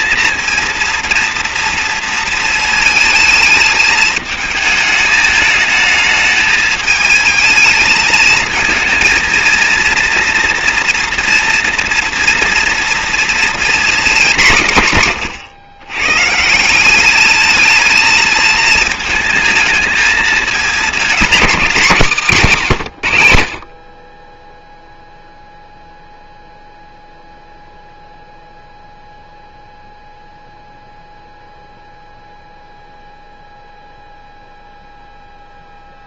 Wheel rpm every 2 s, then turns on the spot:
230, 220, 220, 220, 220, 230, 230, 180, 170, 220, 220, 170, 10, 0, 0, 0, 0, 0.
none